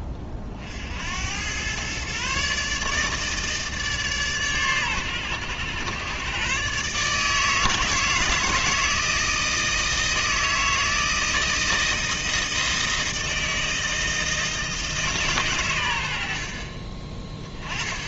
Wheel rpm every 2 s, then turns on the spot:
50, 150, 120, 140, 160, 160, 160, 160, 50.
none